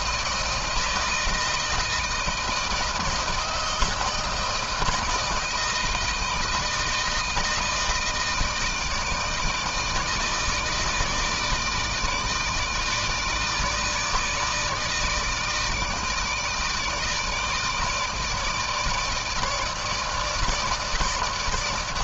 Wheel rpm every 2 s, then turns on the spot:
160, 170, 160, 160, 160, 160, 160, 160, 160, 160, 160.
none